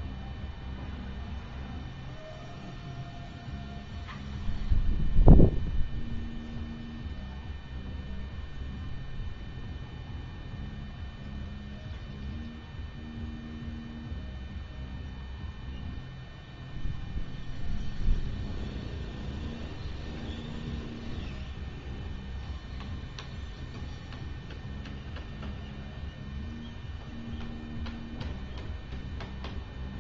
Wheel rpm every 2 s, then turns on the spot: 0, 0, 0, 0, 0, 0, 0, 0, 0, 0, 0, 0, 0, 0, 0.
none